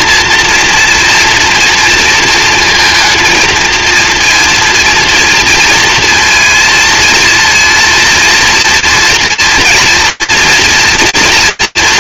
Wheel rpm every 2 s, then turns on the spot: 230, 230, 230, 230, 230, 230.
none